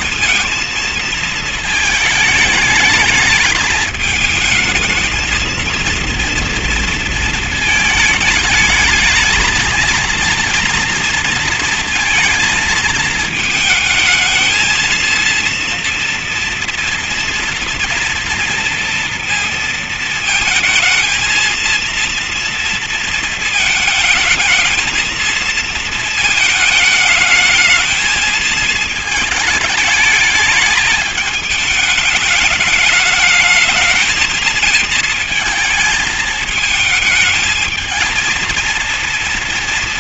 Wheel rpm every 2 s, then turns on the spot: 230, 210, 220, 230, 220, 230, 230, 220, 230, 230, 220, 230, 220, 220, 220, 210, 210, 220, 220, 220.
none